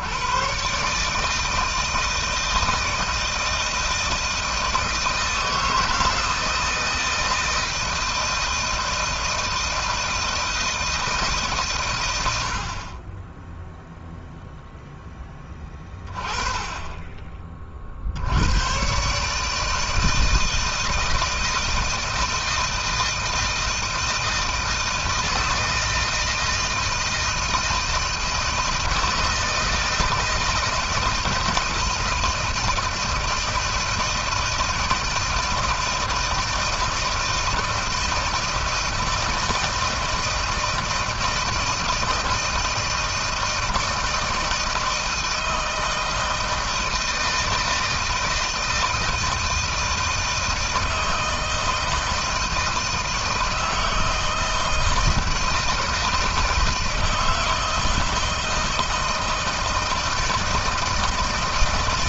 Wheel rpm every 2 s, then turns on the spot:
130, 160, 160, 160, 160, 160, 30, 0, 10, 120, 160, 160, 160, 160, 160, 160, 160, 160, 160, 160, 160, 160, 160, 160, 160, 160, 160, 160, 160, 160, 160.
none